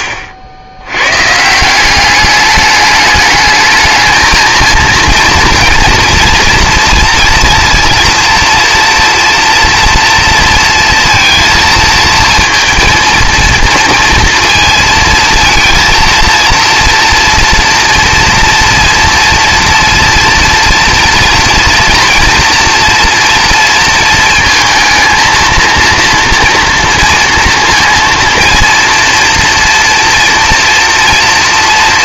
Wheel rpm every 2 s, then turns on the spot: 90, 210, 230, 230, 230, 230, 230, 230, 230, 230, 230, 230, 230, 230, 230, 230.
none